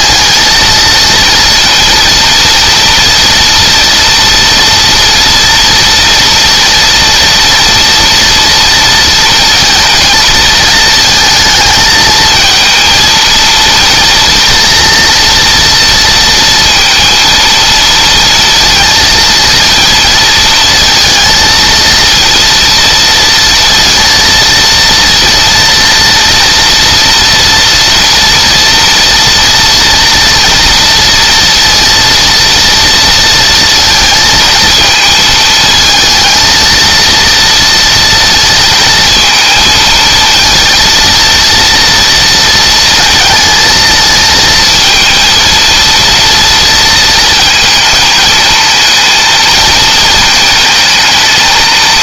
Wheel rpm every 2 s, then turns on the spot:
230, 230, 230, 230, 230, 220, 230, 240, 230, 230, 230, 230, 230, 230, 230, 230, 230, 220, 230, 230, 230, 230, 230, 230, 230, 220.
none